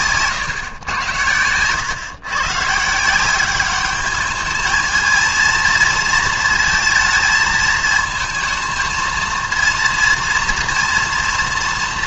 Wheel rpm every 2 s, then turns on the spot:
130, 140, 210, 230, 230, 230.
none